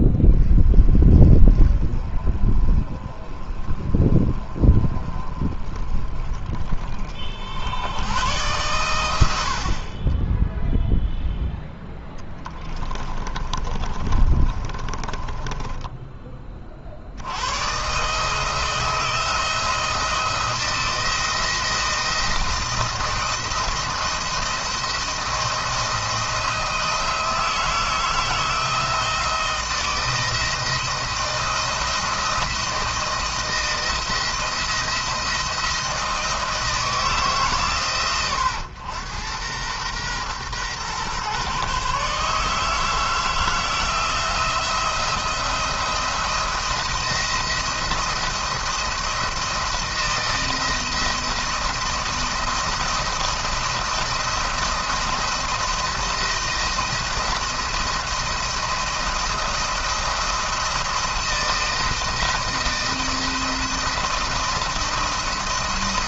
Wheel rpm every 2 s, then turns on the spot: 20, 30, 30, 40, 110, 10, 20, 30, 40, 160, 170, 170, 170, 160, 160, 170, 170, 160, 160, 110, 120, 150, 170, 170, 170, 170, 170, 170, 170, 160, 160, 170, 170.
12-16